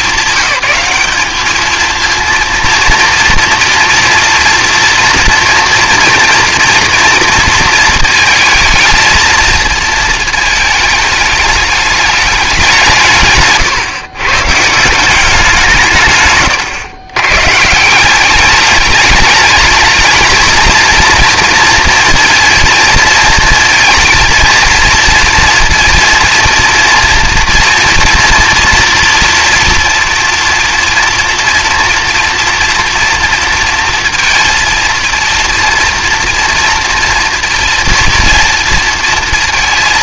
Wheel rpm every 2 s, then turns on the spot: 200, 230, 230, 230, 220, 220, 160, 170, 110, 210, 220, 220, 230, 230, 230, 230, 230, 230, 230, 230.
none